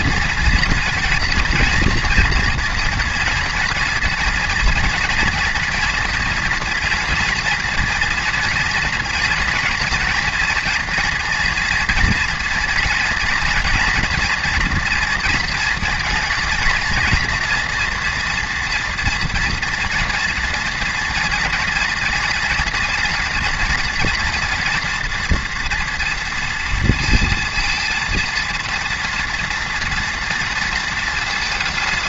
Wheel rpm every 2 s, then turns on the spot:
230, 230, 230, 230, 230, 230, 230, 230, 230, 240, 240, 230, 230, 230, 230, 220.
none